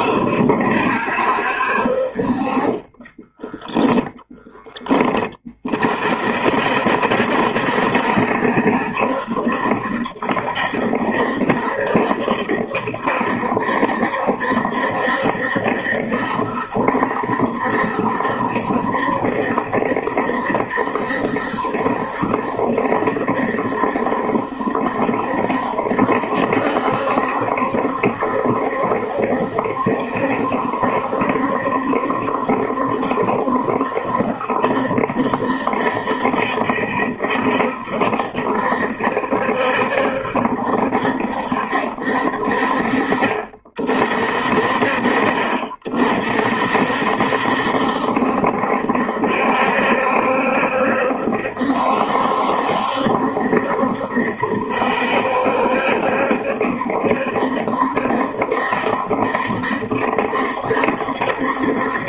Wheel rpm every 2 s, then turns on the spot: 60, 30, 10, 60, 70, 70, 70, 70, 70, 70, 70, 70, 70, 70, 70, 70, 70, 70, 70, 70, 70, 50, 40, 60, 70, 70, 70, 70, 70, 70, 70.
none